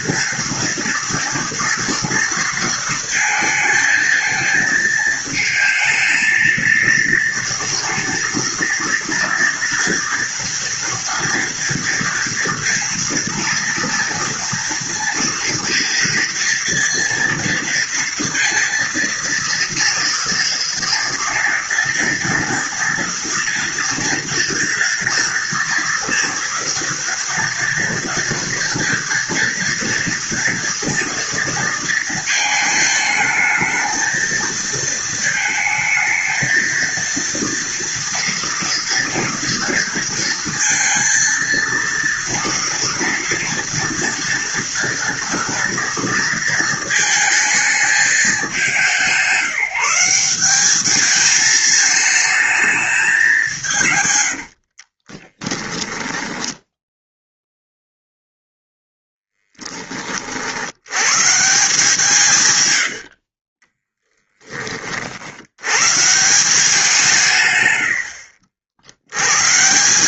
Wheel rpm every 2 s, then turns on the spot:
230, 230, 220, 230, 230, 230, 230, 230, 230, 230, 230, 230, 230, 230, 230, 230, 220, 220, 230, 230, 230, 230, 240, 220, 180, 200, 220, 60, 10, 10, 90, 90, 40, 170, 70.
54-56 62-64